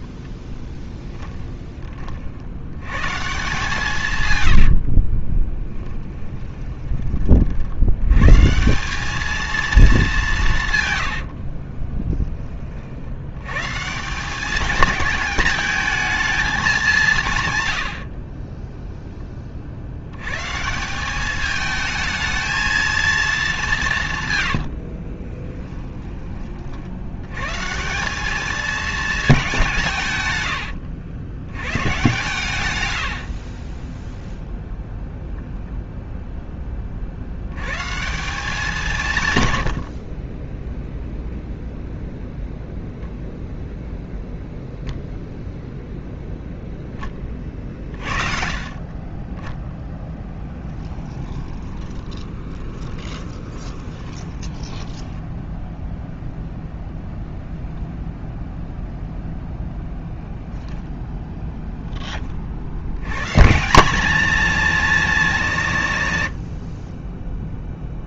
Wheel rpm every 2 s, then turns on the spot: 10, 100, 50, 20, 180, 140, 50, 210, 200, 10, 170, 220, 70, 70, 220, 90, 100, 0, 30, 170, 0, 0, 0, 10, 40, 20, 20, 10, 0, 0, 0, 70, 220, 40.
0-2 4-6 18-20 24-26 50-56